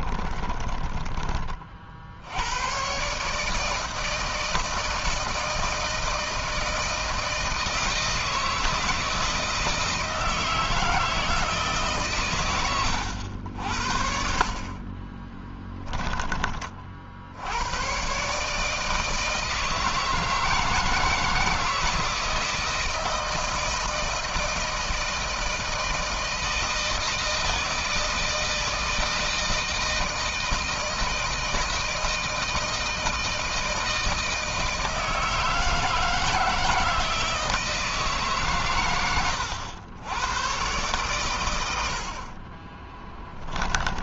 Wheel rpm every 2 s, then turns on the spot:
20, 130, 160, 160, 160, 160, 100, 30, 40, 160, 160, 160, 160, 160, 160, 160, 160, 160, 160, 110, 120, 20.
0-2 14-16 38-40 42-44